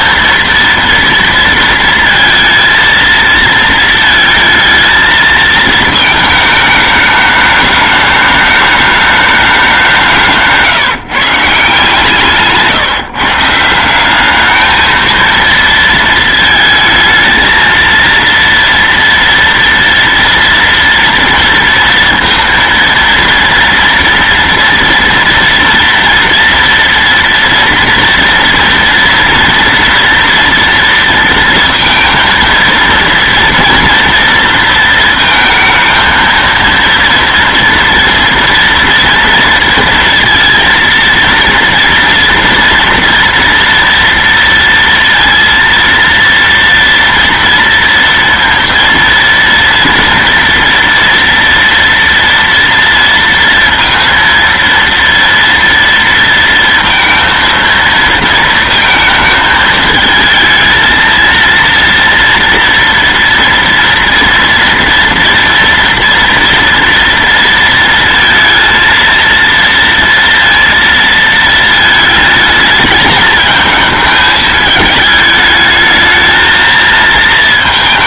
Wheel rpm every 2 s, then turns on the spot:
230, 230, 220, 220, 210, 170, 150, 200, 230, 230, 230, 230, 230, 230, 230, 230, 230, 230, 230, 230, 230, 240, 230, 230, 230, 230, 230, 230, 230, 230, 220, 230, 230, 230, 230, 230, 220, 220, 220.
none